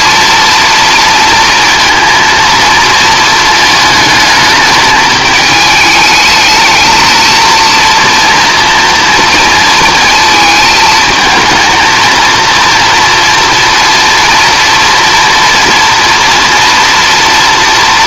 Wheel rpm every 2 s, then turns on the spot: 230, 220, 210, 220, 230, 220, 230, 240, 230.
none